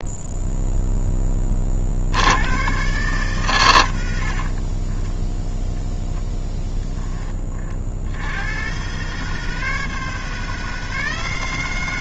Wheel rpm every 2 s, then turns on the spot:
0, 120, 20, 10, 130, 160.
4-6